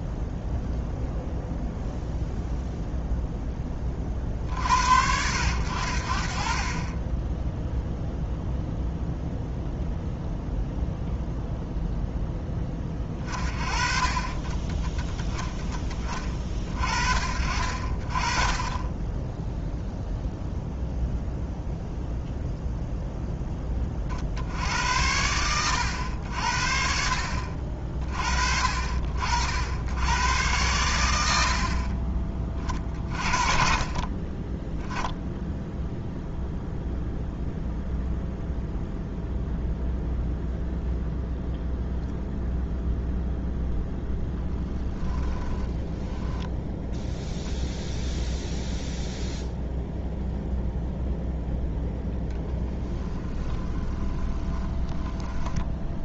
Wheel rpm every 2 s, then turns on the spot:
0, 0, 60, 30, 0, 0, 20, 20, 40, 20, 0, 0, 80, 60, 50, 100, 30, 10, 0, 0, 0, 0, 10, 0, 0, 0, 10, 10.
44-46 52-56